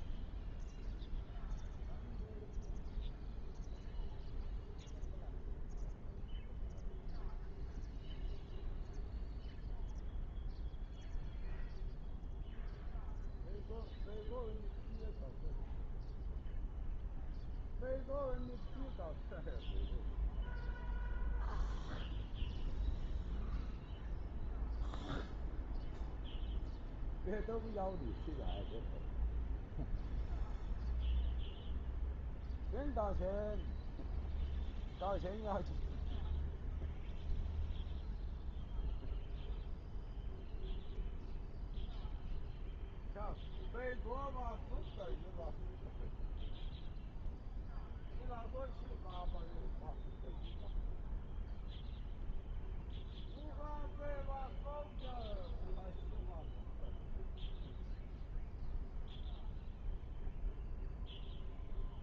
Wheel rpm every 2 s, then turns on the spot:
0, 0, 0, 0, 0, 0, 0, 0, 0, 0, 0, 0, 0, 0, 0, 0, 0, 0, 0, 0, 0, 0, 0, 0, 0, 0, 0, 0, 0, 0, 0.
none